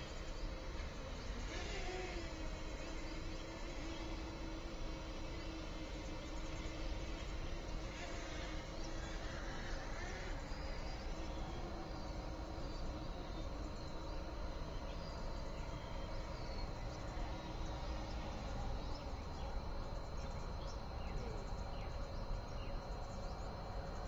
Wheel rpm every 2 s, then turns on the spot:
0, 0, 0, 0, 0, 0, 0, 0, 0, 0, 0, 0.
none